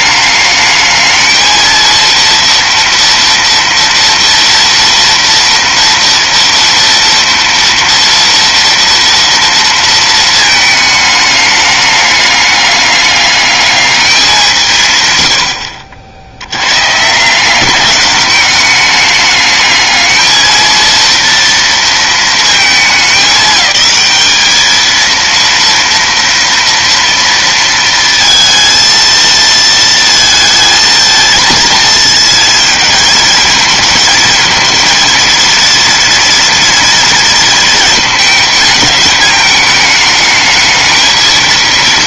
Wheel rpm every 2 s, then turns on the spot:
210, 230, 230, 230, 230, 220, 210, 180, 100, 200, 230, 220, 220, 230, 230, 220, 230, 230, 230, 220, 220.
none